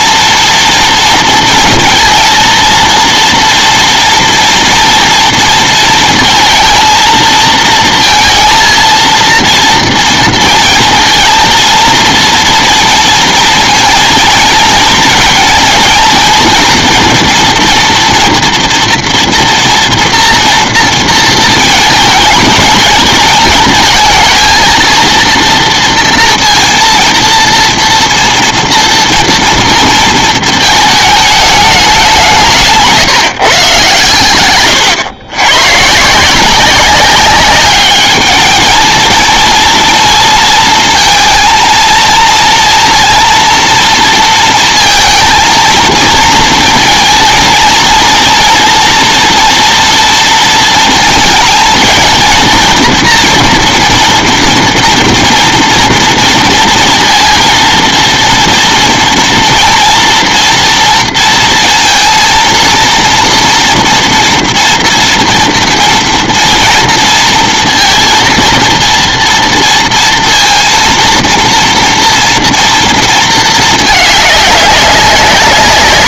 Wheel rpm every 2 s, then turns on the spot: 230, 230, 230, 230, 230, 230, 230, 230, 240, 230, 230, 220, 230, 230, 230, 220, 170, 120, 180, 220, 230, 230, 230, 230, 230, 230, 230, 230, 230, 230, 230, 230, 230, 230, 230, 230, 230, 200.
34-36